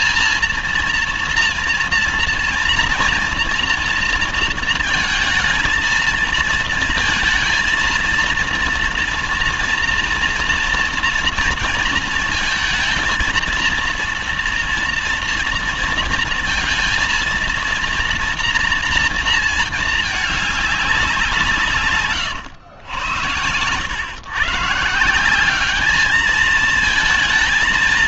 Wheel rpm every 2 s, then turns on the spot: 230, 230, 230, 220, 230, 230, 230, 230, 230, 230, 200, 100, 150, 220.
none